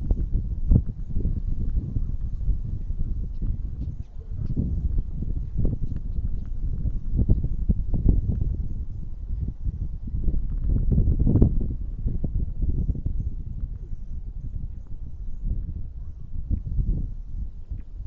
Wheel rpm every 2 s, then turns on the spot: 0, 0, 0, 0, 0, 0, 0, 0, 0.
none